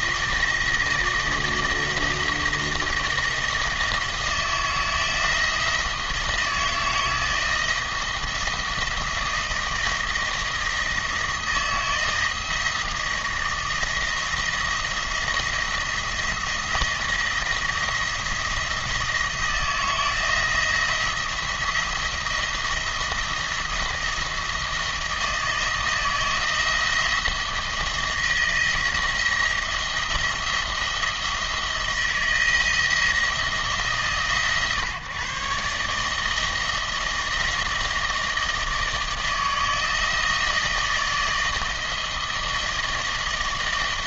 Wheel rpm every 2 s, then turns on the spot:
160, 160, 160, 160, 170, 160, 160, 170, 170, 170, 160, 170, 170, 160, 160, 170, 170, 130, 160, 160, 160, 160.
none